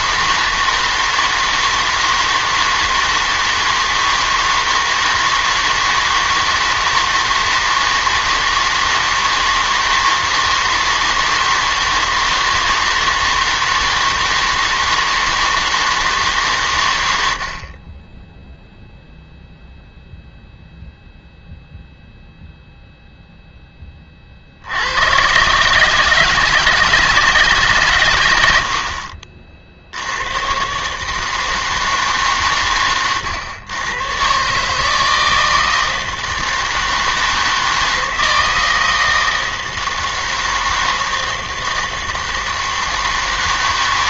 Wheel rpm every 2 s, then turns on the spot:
160, 160, 160, 160, 160, 160, 160, 160, 120, 0, 0, 0, 100, 160, 50, 130, 120, 150, 160, 160, 160, 160.
none